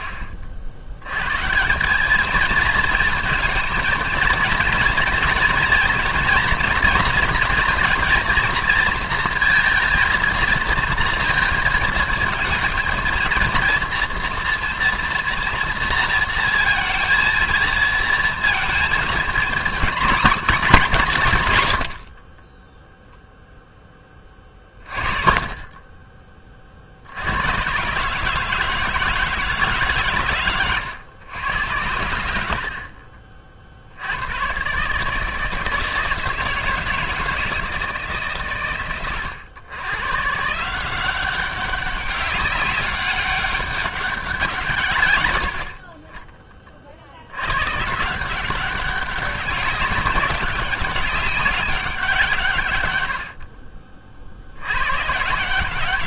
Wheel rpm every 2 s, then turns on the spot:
90, 230, 240, 230, 230, 230, 230, 230, 230, 220, 130, 0, 40, 100, 150, 100, 50, 160, 160, 100, 190, 200, 80, 80, 190, 190, 80, 150.
none